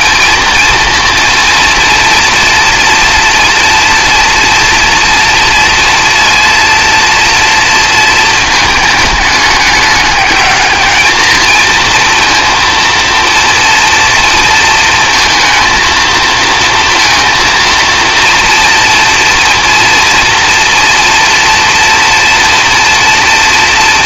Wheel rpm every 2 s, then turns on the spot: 230, 230, 230, 230, 210, 210, 230, 230, 230, 240, 230, 230.
none